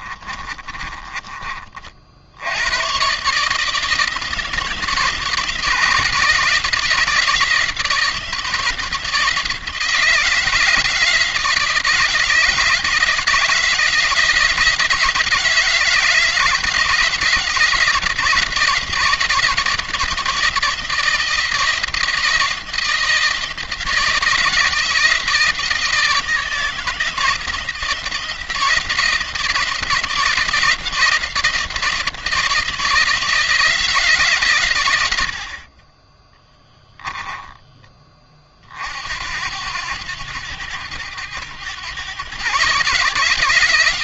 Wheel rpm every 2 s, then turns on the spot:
30, 120, 160, 160, 160, 160, 160, 160, 170, 170, 160, 170, 160, 170, 170, 170, 170, 110, 10, 50, 90, 140.
0-2